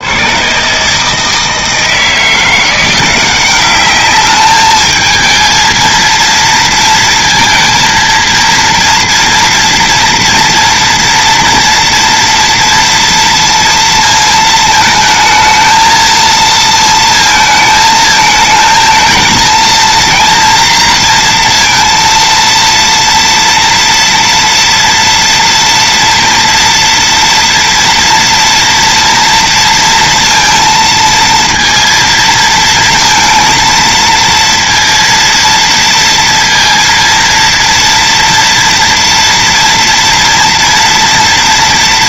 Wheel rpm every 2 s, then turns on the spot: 100, 170, 210, 230, 230, 230, 230, 220, 230, 220, 230, 230, 230, 230, 230, 230, 230, 230, 230, 230, 230.
none